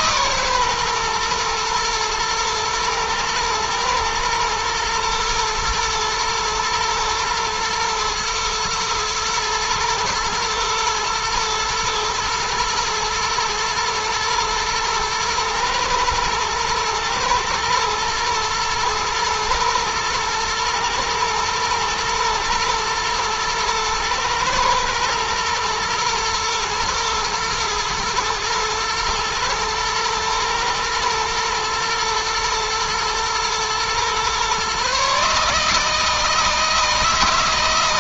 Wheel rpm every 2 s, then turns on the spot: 120, 110, 120, 120, 120, 110, 120, 110, 110, 110, 110, 110, 110, 120, 110, 110, 110, 140, 160.
none